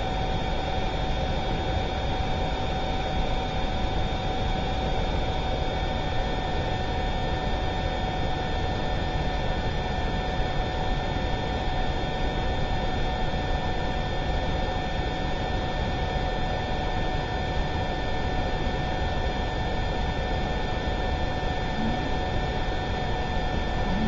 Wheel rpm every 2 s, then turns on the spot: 0, 0, 0, 0, 0, 0, 0, 0, 0, 0, 0, 0.
none